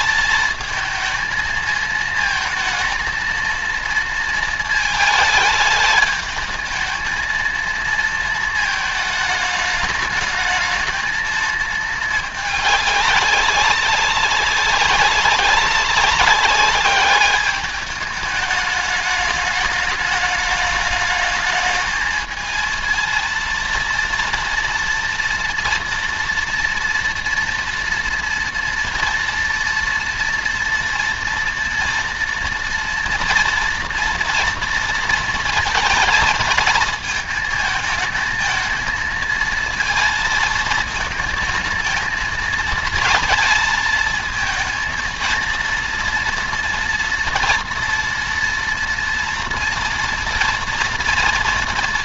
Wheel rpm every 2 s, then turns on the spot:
220, 230, 230, 220, 230, 220, 210, 190, 200, 210, 210, 220, 230, 230, 240, 230, 230, 230, 220, 220, 220, 220, 230, 230, 230, 230.
none